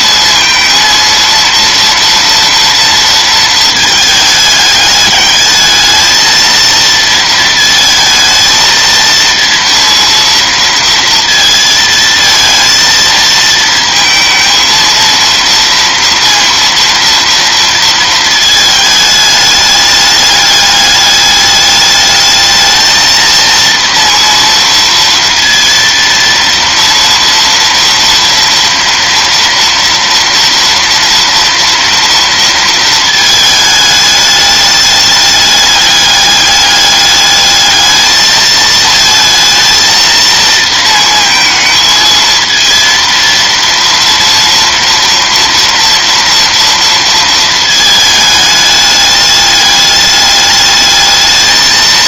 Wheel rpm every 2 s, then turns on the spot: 230, 230, 210, 230, 230, 230, 220, 230, 230, 220, 210, 220, 230, 230, 230, 240, 230, 210, 210, 220, 230, 230, 230, 230, 210, 210.
none